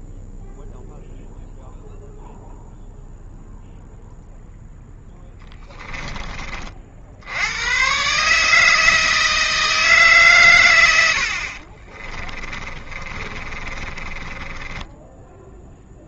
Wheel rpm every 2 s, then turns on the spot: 0, 0, 0, 40, 160, 110, 30, 10.
12-16